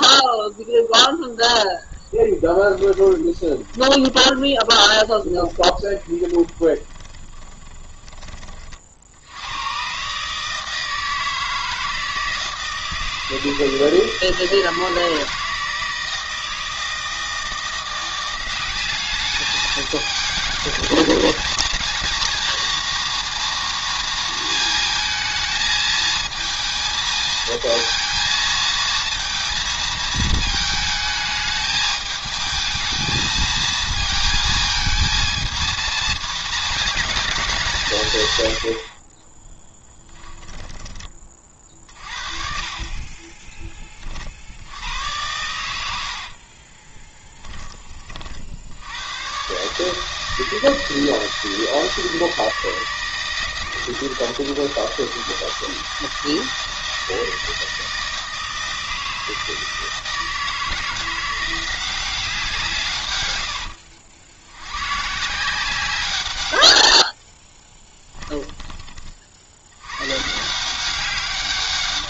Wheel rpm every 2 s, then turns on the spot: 0, 10, 30, 20, 50, 160, 160, 160, 160, 190, 220, 230, 220, 220, 220, 220, 220, 220, 230, 80, 20, 40, 90, 30, 80, 160, 160, 160, 160, 160, 170, 160, 120, 90, 20, 170.
2-8 38-42 46-48 66-68